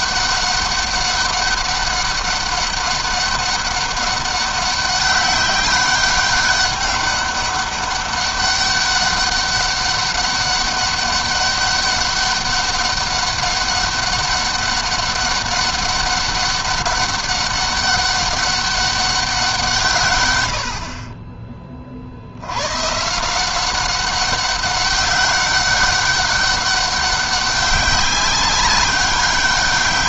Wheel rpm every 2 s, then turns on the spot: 200, 200, 190, 200, 200, 200, 200, 200, 200, 200, 90, 90, 200, 190, 190.
none